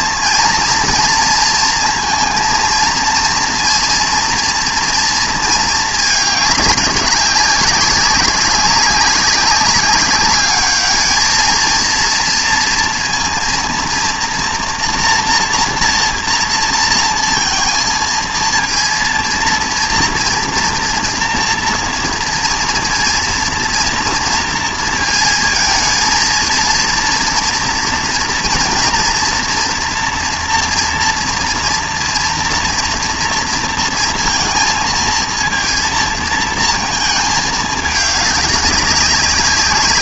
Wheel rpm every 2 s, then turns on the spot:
230, 230, 230, 200, 190, 210, 230, 230, 230, 230, 230, 230, 230, 230, 230, 230, 230, 230, 220, 200.
none